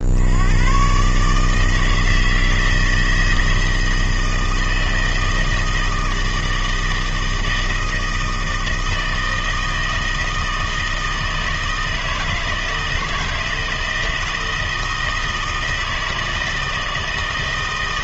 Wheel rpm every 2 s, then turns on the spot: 120, 160, 160, 160, 160, 160, 160, 160, 160.
none